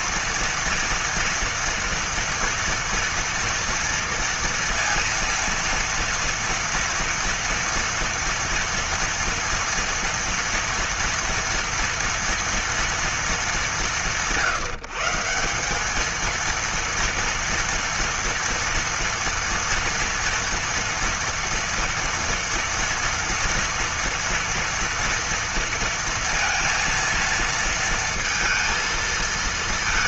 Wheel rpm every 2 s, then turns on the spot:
240, 230, 230, 230, 230, 230, 230, 150, 230, 230, 230, 230, 230, 230, 230.
none